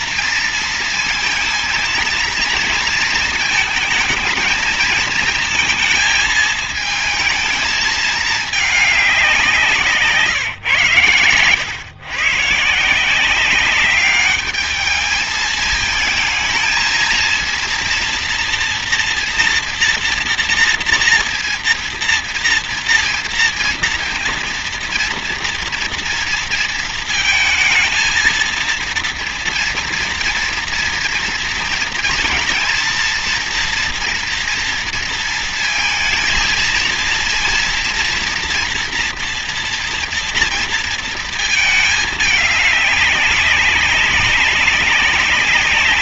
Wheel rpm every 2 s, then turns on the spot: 230, 230, 230, 220, 190, 120, 190, 220, 230, 230, 230, 230, 230, 220, 230, 230, 230, 230, 230, 230, 220, 200, 190.
none